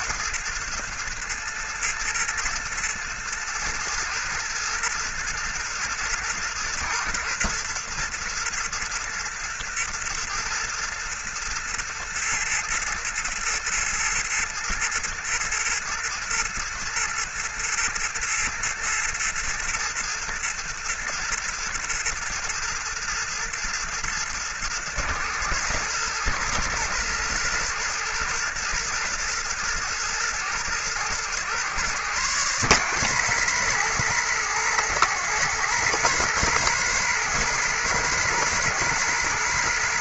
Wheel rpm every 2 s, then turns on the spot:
120, 110, 110, 110, 120, 120, 120, 120, 110, 110, 110, 110, 110, 110, 110, 120, 140, 140, 150, 150.
none